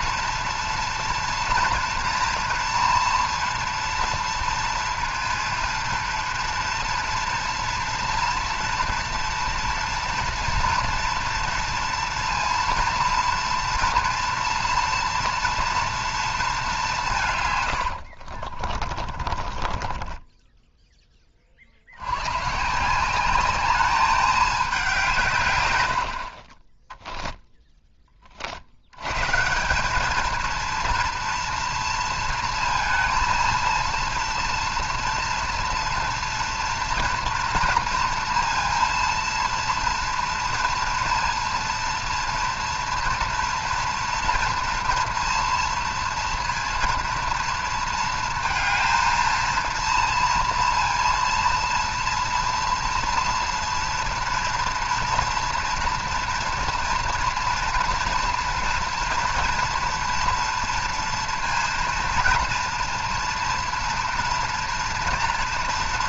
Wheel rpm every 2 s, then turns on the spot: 230, 230, 230, 230, 230, 240, 230, 230, 190, 30, 10, 170, 190, 10, 90, 230, 230, 230, 230, 230, 230, 230, 230, 230, 230, 230, 230, 230, 230, 230, 230, 230, 230.
18-20